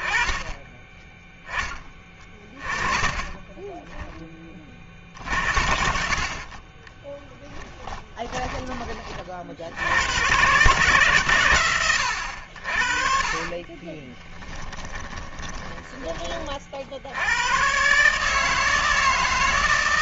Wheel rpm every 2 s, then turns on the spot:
10, 20, 50, 10, 30, 130, 40, 20, 80, 160.
2-4 6-8 12-16